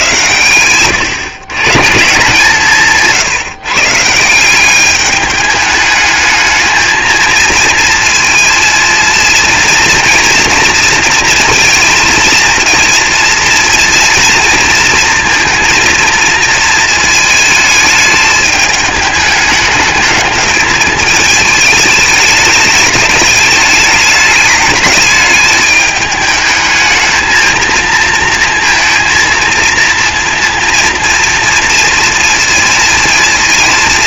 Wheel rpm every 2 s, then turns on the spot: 110, 160, 190, 220, 230, 230, 230, 230, 230, 210, 220, 220, 210, 220, 230, 230, 230.
none